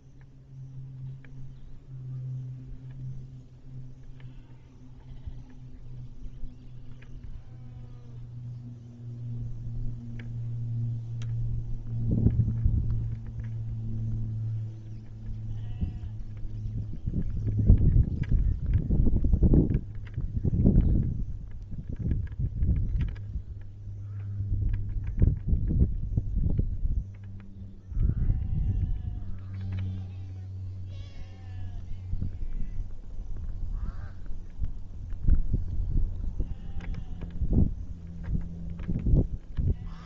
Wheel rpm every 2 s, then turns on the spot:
0, 0, 0, 0, 0, 0, 0, 0, 0, 0, 0, 0, 0, 0, 0, 0, 0, 0, 0, 0.
none